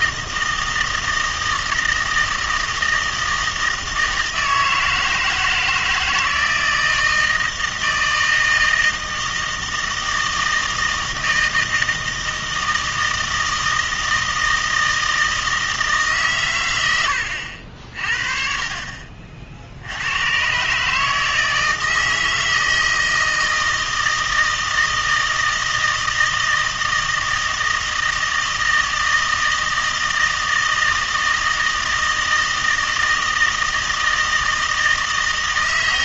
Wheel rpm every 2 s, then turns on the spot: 160, 160, 160, 160, 160, 160, 160, 160, 110, 40, 140, 160, 160, 160, 160, 160, 160, 160.
none